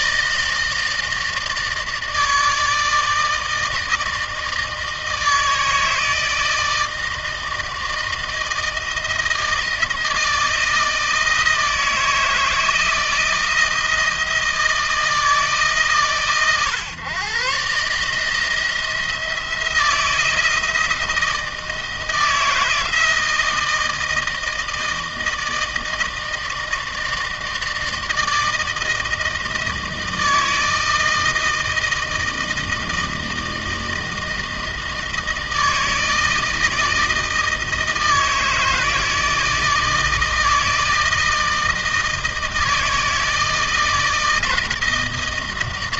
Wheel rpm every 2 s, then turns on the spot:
160, 160, 160, 160, 160, 160, 160, 160, 130, 170, 160, 160, 160, 160, 160, 160, 160, 160, 160, 160, 160, 160, 160.
none